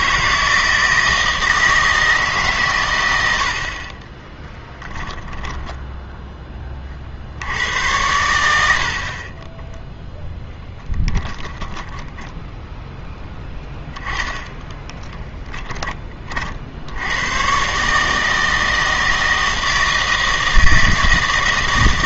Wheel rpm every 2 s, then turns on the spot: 160, 130, 10, 30, 60, 10, 10, 20, 70, 160, 160.
4-6 8-12 14-16